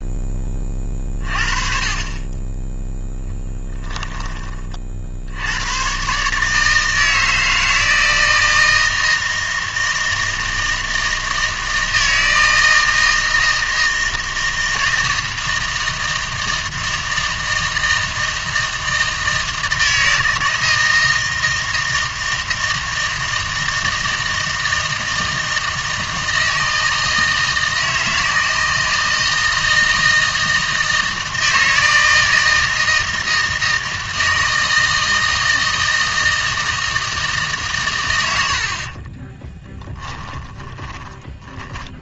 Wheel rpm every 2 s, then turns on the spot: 30, 10, 30, 150, 160, 160, 160, 160, 160, 160, 160, 160, 160, 160, 160, 160, 160, 160, 160, 60, 20.
40-42